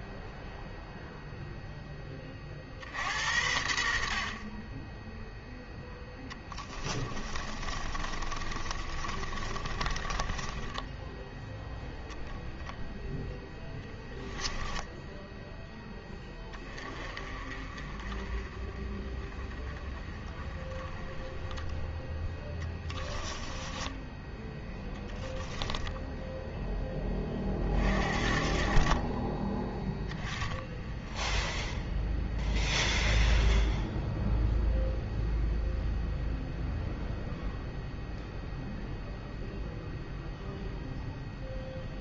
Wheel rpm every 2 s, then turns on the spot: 0, 40, 30, 10, 30, 20, 0, 10, 20, 30, 20, 10, 10, 0, 40, 10, 0, 0, 0, 0, 0.
6-12 22-24